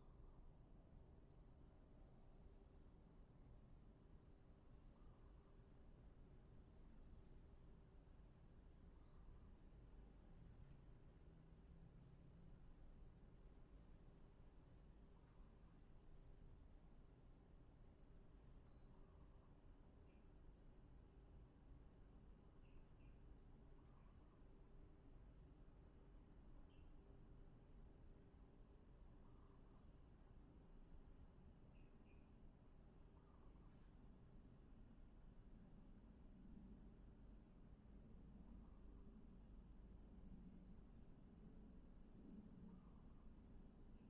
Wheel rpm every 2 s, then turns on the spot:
0, 0, 0, 0, 0, 0, 0, 0, 0, 0, 0, 0, 0, 0, 0, 0, 0, 0, 0, 0, 0, 0.
none